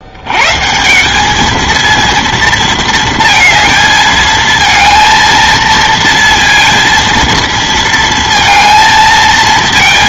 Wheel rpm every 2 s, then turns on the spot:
160, 230, 230, 230, 230.
none